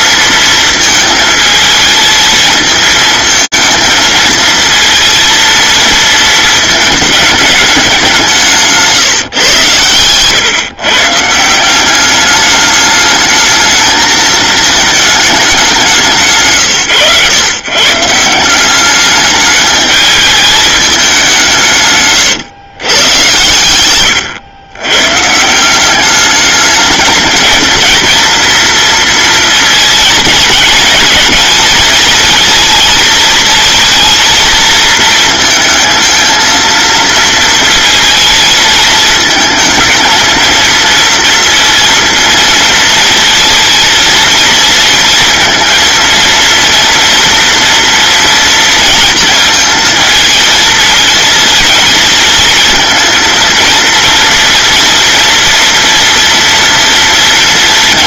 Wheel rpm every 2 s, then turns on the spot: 220, 220, 220, 220, 160, 140, 210, 220, 130, 200, 210, 120, 120, 210, 230, 220, 220, 220, 230, 220, 230, 230, 230, 230, 230, 220, 230, 230, 230.
none